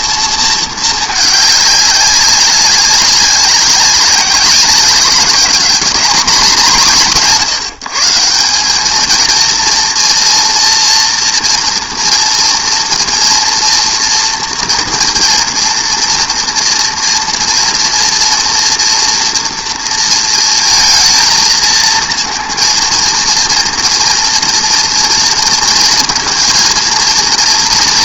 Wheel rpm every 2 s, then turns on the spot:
220, 190, 190, 220, 200, 230, 230, 230, 230, 230, 230, 230, 230, 230.
none